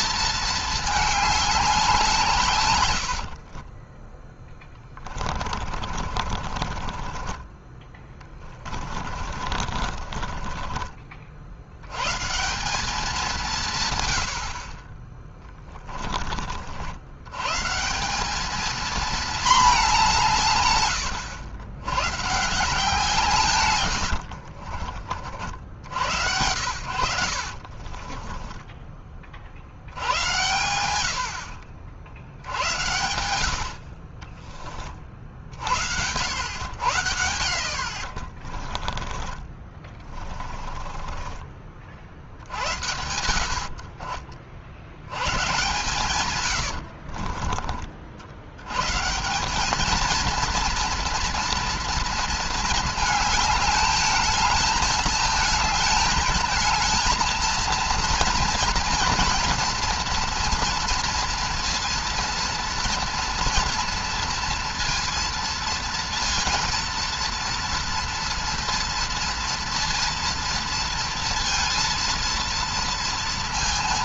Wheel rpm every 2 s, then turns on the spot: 220, 120, 20, 50, 30, 40, 180, 50, 60, 220, 120, 160, 50, 90, 20, 80, 70, 40, 90, 30, 30, 60, 70, 90, 120, 230, 220, 220, 220, 230, 230, 230, 230, 230, 230, 230, 230.
2-12 24-30 38-42 46-48